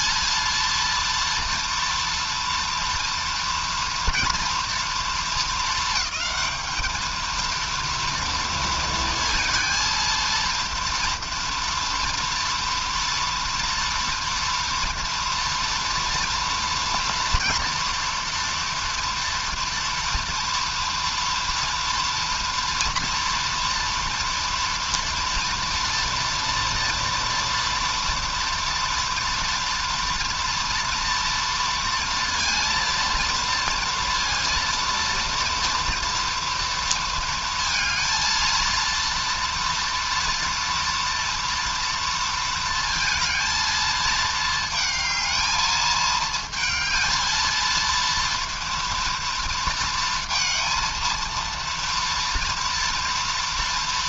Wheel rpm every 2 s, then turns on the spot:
230, 230, 230, 220, 230, 230, 230, 230, 230, 230, 230, 230, 230, 230, 230, 240, 230, 230, 230, 220, 230, 230, 220, 220, 230, 230, 230.
none